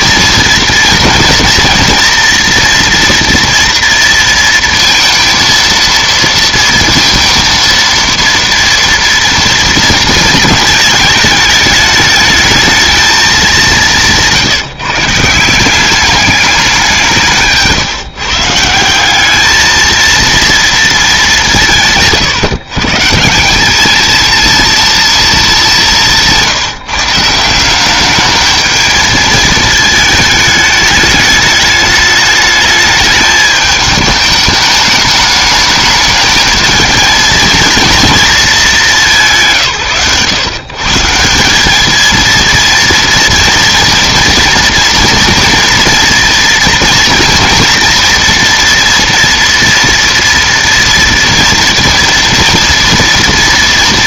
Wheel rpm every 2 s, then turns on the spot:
230, 230, 230, 230, 230, 230, 220, 150, 200, 160, 230, 140, 230, 160, 210, 220, 210, 210, 220, 220, 130, 230, 230, 240, 240, 230, 230.
none